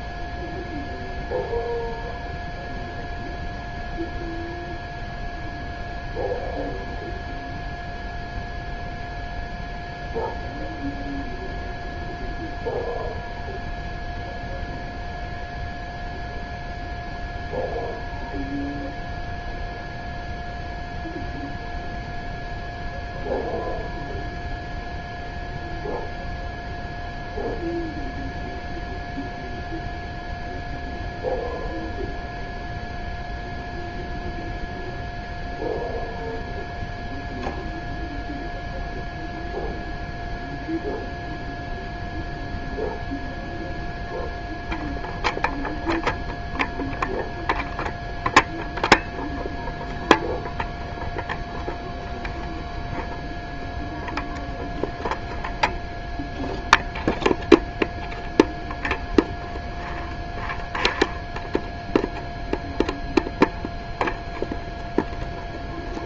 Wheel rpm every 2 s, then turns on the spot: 0, 0, 0, 0, 0, 0, 0, 0, 0, 0, 0, 0, 0, 0, 0, 0, 0, 0, 0, 0, 0, 0, 0, 0, 0, 0, 0, 0, 0, 0, 0, 0, 0.
none